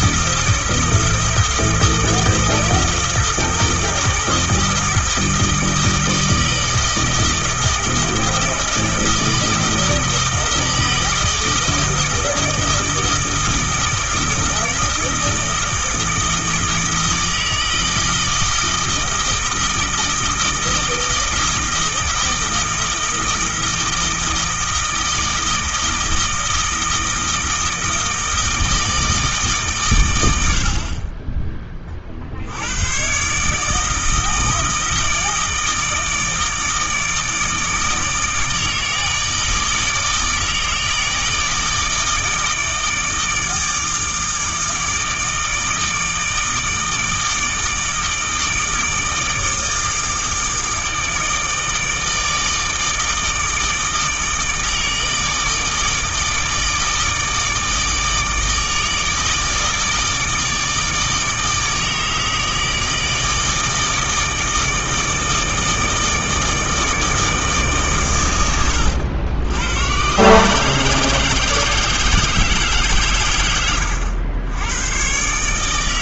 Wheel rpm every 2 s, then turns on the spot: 160, 160, 160, 160, 160, 160, 160, 160, 160, 160, 160, 160, 160, 160, 160, 40, 120, 160, 150, 160, 160, 160, 160, 160, 160, 160, 160, 160, 160, 160, 160, 160, 160, 160, 90, 160, 140, 120.
none